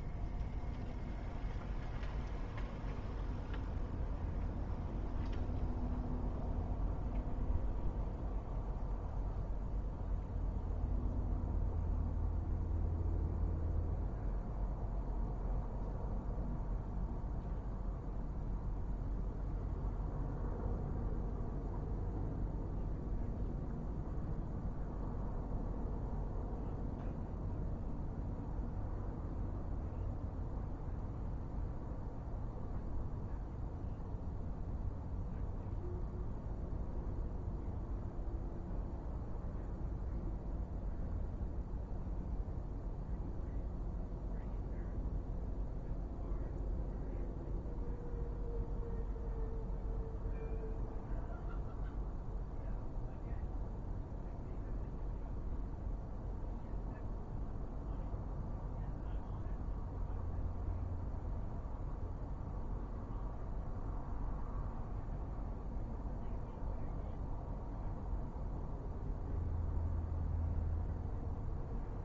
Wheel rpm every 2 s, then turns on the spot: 0, 0, 0, 0, 0, 0, 0, 0, 0, 0, 0, 0, 0, 0, 0, 0, 0, 0, 0, 0, 0, 0, 0, 0, 0, 0, 0, 0, 0, 0, 0, 0, 0, 0, 0, 0.
none